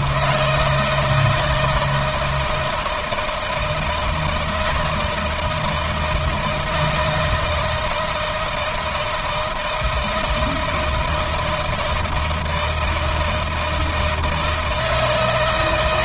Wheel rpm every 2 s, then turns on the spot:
160, 160, 160, 160, 160, 160, 160, 150.
none